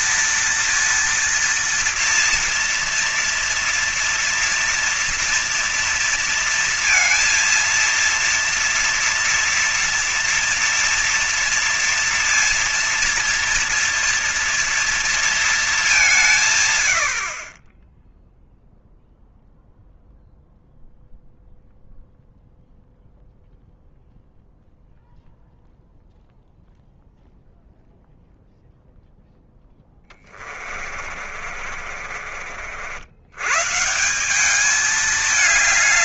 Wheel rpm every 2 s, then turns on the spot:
230, 230, 230, 230, 230, 230, 230, 230, 110, 0, 0, 0, 0, 0, 0, 40, 80, 210.
30-32